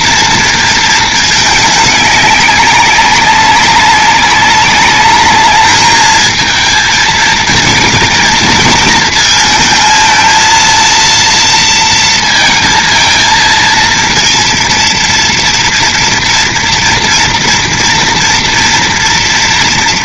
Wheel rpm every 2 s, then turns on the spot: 230, 200, 200, 220, 220, 230, 230, 230, 230, 230.
none